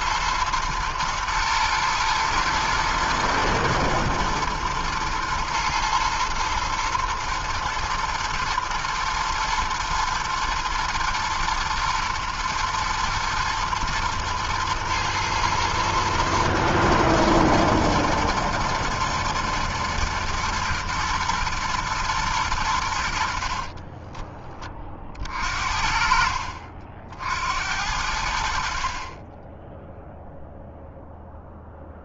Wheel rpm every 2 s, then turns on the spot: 110, 120, 110, 120, 120, 110, 120, 110, 120, 120, 110, 110, 20, 60, 70, 0.
none